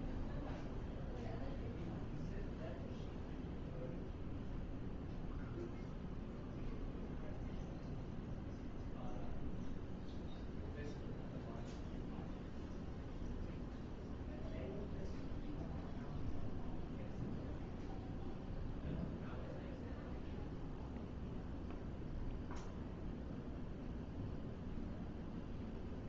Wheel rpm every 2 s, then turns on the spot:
0, 0, 0, 0, 0, 0, 0, 0, 0, 0, 0, 0, 0.
none